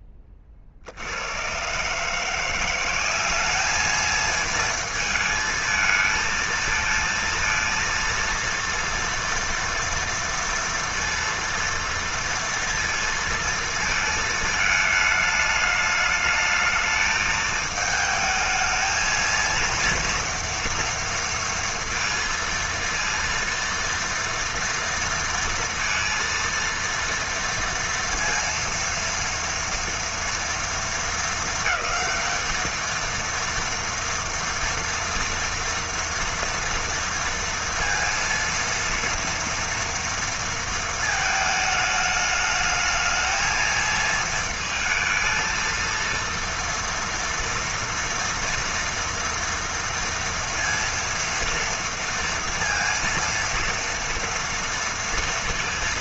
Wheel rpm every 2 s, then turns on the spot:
70, 180, 220, 230, 230, 230, 230, 220, 220, 220, 230, 230, 230, 230, 230, 220, 220, 230, 230, 230, 230, 220, 230, 230, 230, 230, 230, 230.
none